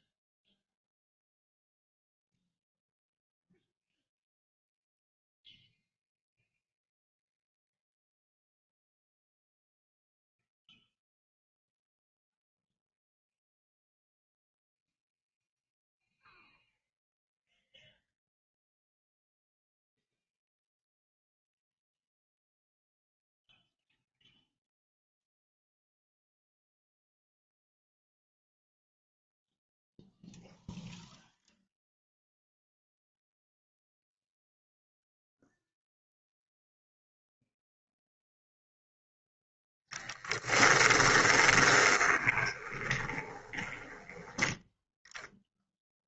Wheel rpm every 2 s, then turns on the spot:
0, 0, 0, 0, 0, 0, 0, 0, 0, 0, 0, 0, 0, 0, 0, 0, 0, 0, 0, 0, 10, 20, 10.
40-44